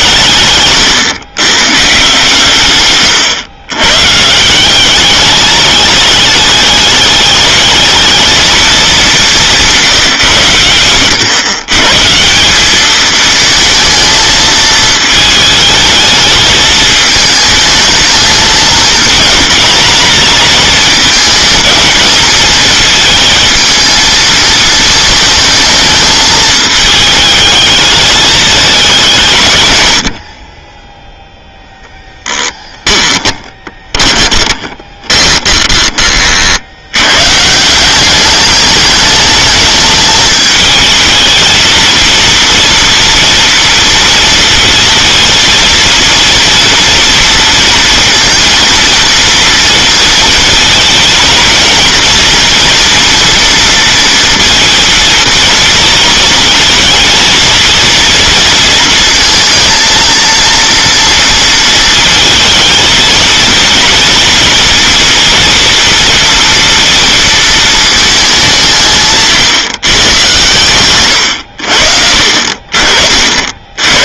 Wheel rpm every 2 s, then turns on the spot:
120, 130, 180, 210, 210, 100, 200, 220, 210, 220, 220, 220, 220, 210, 190, 10, 10, 20, 70, 210, 220, 230, 230, 230, 230, 230, 230, 230, 220, 230, 230, 220, 230, 230, 170, 110, 40.
0-2 32-36